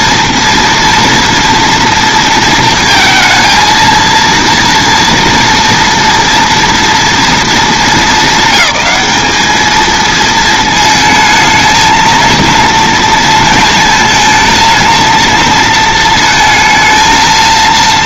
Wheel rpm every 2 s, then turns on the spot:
230, 230, 230, 230, 200, 220, 230, 230, 220.
none